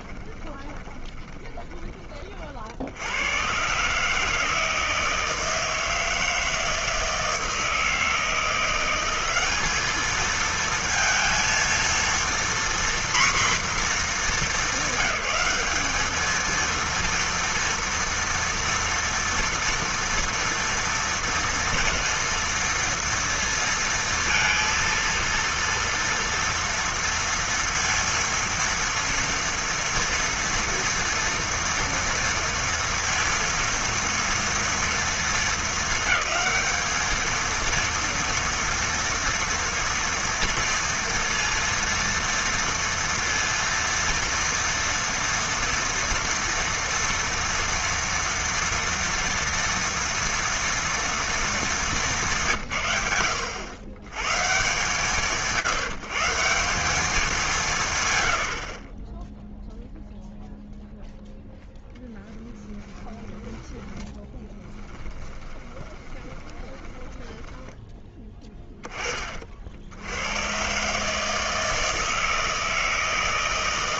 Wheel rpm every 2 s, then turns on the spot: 20, 100, 160, 160, 190, 230, 250, 200, 230, 230, 230, 230, 230, 240, 230, 230, 230, 230, 220, 230, 230, 230, 230, 230, 230, 230, 170, 110, 170, 60, 0, 0, 10, 20, 20, 100, 160.
0-2 64-68